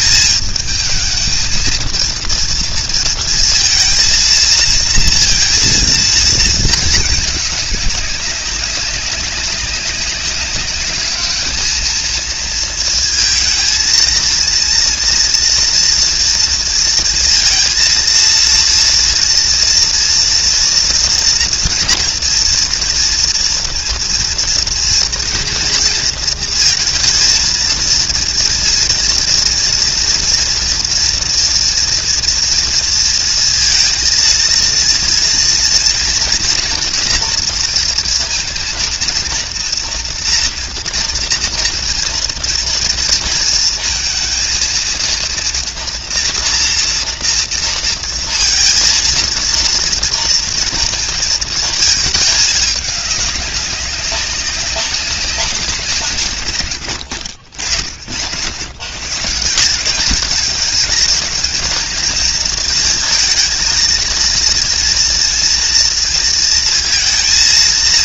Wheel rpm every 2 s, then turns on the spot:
220, 230, 230, 220, 200, 200, 230, 230, 230, 230, 230, 230, 230, 230, 230, 230, 230, 230, 230, 230, 230, 230, 230, 230, 230, 230, 210, 200, 80, 100, 210, 220, 230, 230.
none